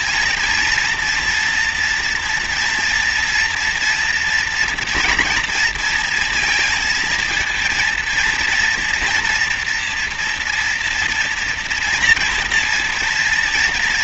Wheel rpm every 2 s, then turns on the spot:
230, 230, 240, 230, 230, 240, 230.
none